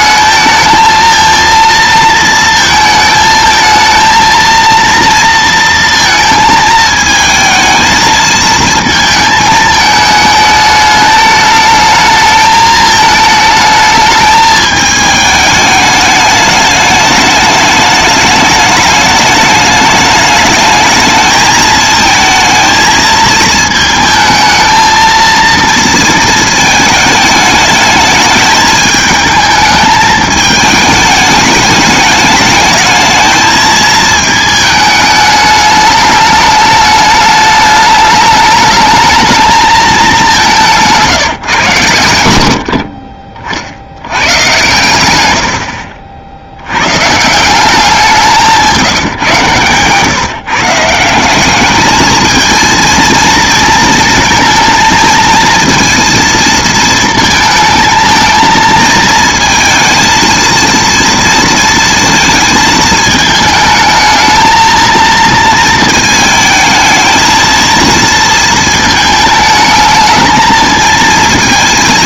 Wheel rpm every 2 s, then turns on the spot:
230, 220, 230, 220, 230, 210, 220, 210, 210, 210, 210, 220, 220, 220, 220, 210, 220, 210, 210, 220, 170, 40, 110, 120, 160, 180, 230, 230, 220, 220, 230, 220, 230, 220, 220, 220.
none